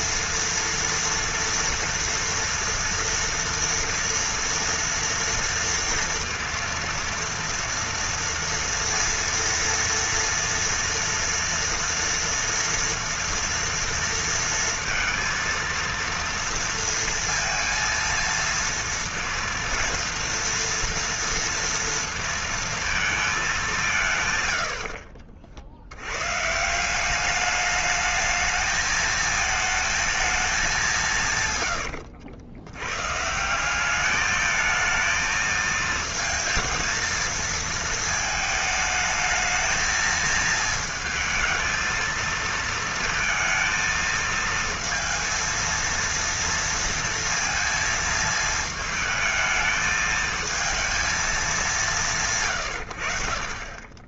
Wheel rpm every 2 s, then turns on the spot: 230, 230, 240, 230, 230, 240, 230, 230, 230, 230, 230, 230, 80, 170, 220, 200, 90, 220, 230, 210, 220, 230, 220, 230, 220, 220, 100.
24-26